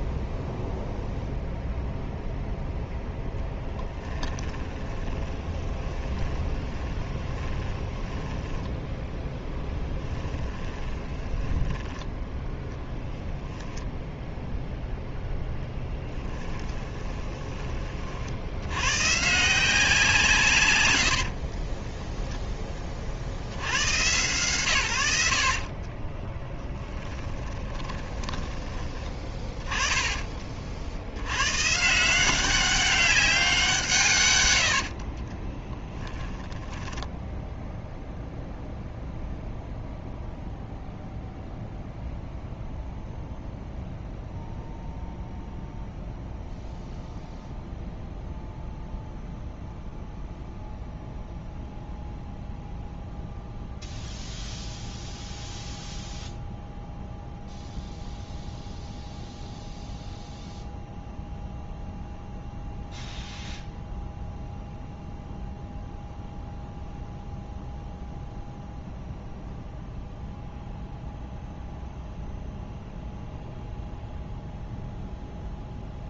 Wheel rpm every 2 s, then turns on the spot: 0, 0, 10, 20, 10, 20, 10, 0, 10, 90, 120, 20, 100, 20, 20, 60, 190, 80, 10, 0, 0, 0, 0, 0, 0, 0, 0, 0, 0, 0, 0, 0, 0, 0, 0, 0, 0, 0.
4-12 16-18 26-28 34-36